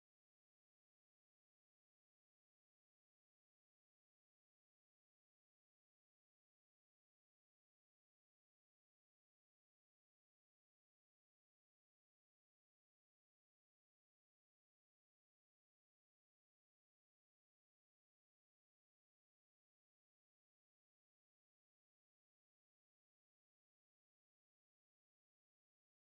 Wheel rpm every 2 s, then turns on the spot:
0, 0, 0, 0, 0, 0, 0, 0, 0, 0, 0, 0, 0.
none